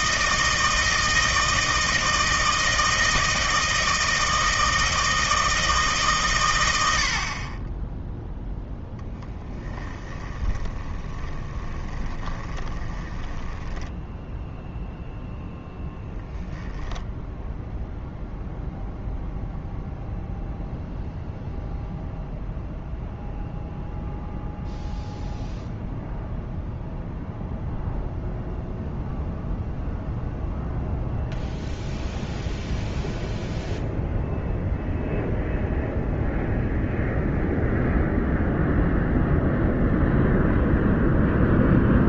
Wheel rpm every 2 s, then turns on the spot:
160, 160, 160, 80, 10, 30, 20, 0, 10, 0, 0, 0, 0, 0, 0, 0, 0, 0, 0, 0, 0.
10-14